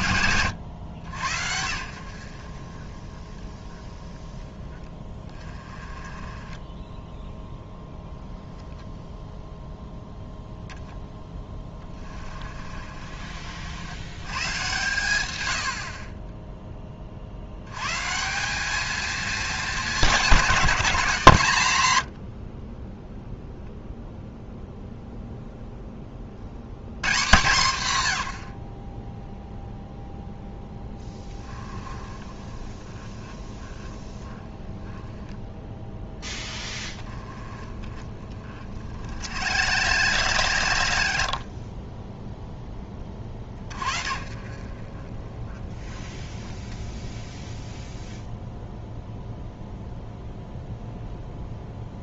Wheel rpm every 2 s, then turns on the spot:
100, 20, 20, 10, 0, 0, 40, 120, 30, 220, 190, 20, 0, 140, 40, 10, 20, 10, 20, 50, 70, 20, 30, 0, 0, 0.
12-14